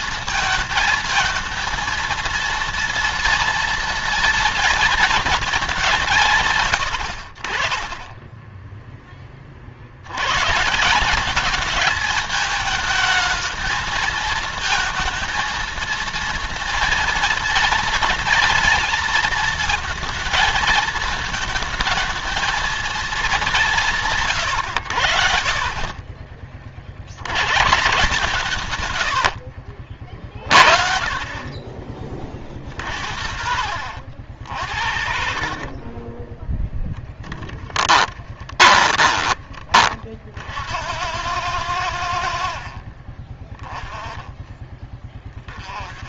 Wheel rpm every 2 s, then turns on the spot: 220, 230, 230, 120, 10, 140, 220, 220, 230, 230, 220, 220, 120, 40, 140, 50, 50, 70, 20, 30, 60, 50, 20.
34-40